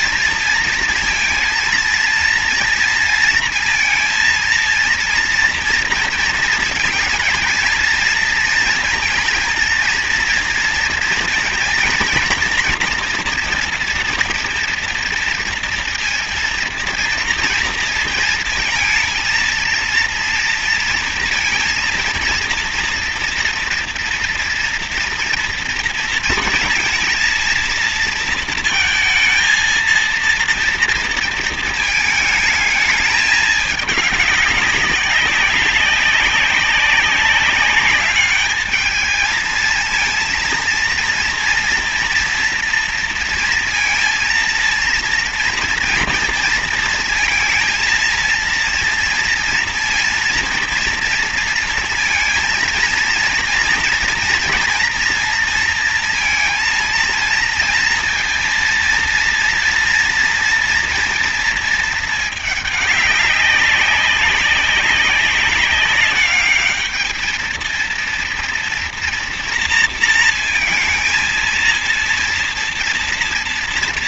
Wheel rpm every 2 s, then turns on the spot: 230, 230, 230, 230, 230, 230, 230, 230, 230, 230, 230, 230, 230, 230, 230, 230, 220, 200, 200, 210, 230, 230, 230, 230, 230, 230, 230, 230, 230, 230, 240, 210, 200, 210, 230, 230, 230.
none